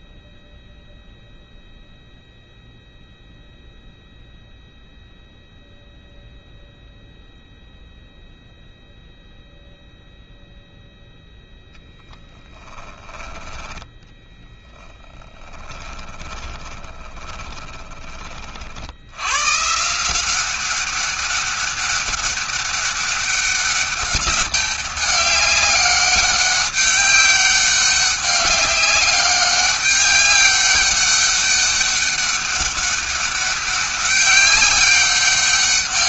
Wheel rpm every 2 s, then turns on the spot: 0, 0, 0, 0, 0, 0, 10, 10, 20, 60, 190, 200, 200, 200, 190, 200, 200, 200.
12-14 16-18